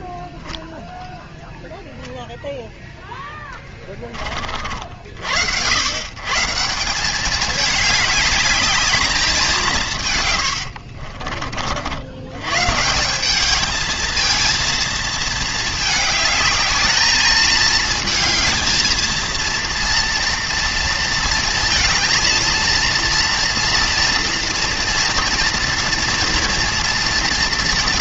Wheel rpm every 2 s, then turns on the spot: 0, 0, 60, 170, 210, 70, 150, 230, 220, 220, 230, 230, 230, 230.
10-12